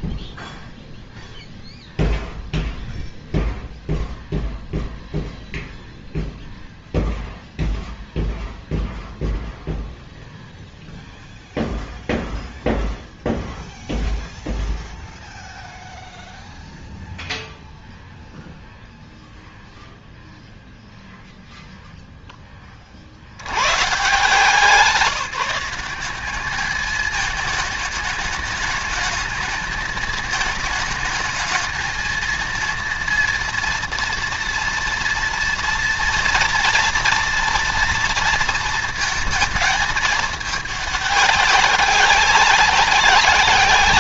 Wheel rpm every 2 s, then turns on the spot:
0, 0, 0, 0, 0, 0, 0, 0, 0, 0, 0, 50, 170, 210, 210, 220, 230, 230, 230, 230, 200, 180.
none